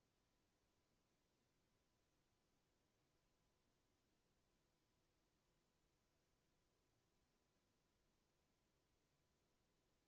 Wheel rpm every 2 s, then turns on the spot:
0, 0, 0, 0, 0.
none